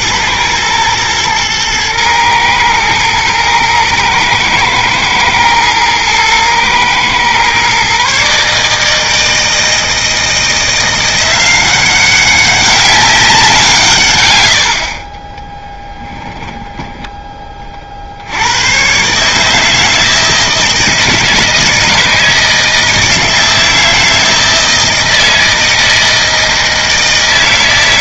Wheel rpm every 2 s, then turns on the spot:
110, 110, 110, 120, 160, 170, 190, 60, 10, 120, 160, 160, 160, 160.
none